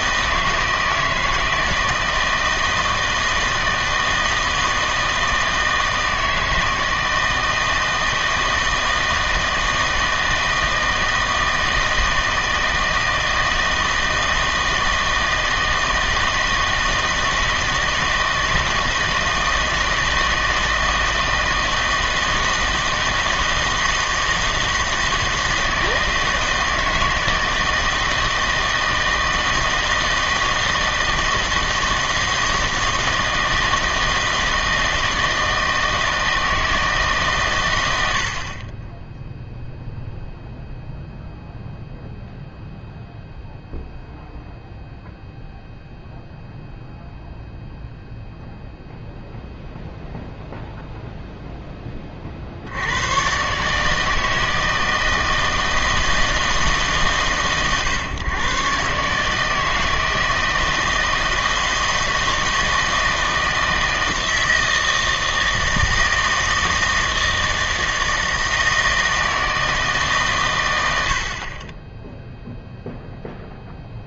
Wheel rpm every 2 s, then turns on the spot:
160, 160, 160, 160, 160, 160, 160, 160, 160, 160, 160, 160, 160, 160, 160, 160, 160, 160, 160, 30, 0, 0, 0, 0, 0, 0, 60, 160, 150, 130, 160, 160, 160, 160, 160, 120, 0.
none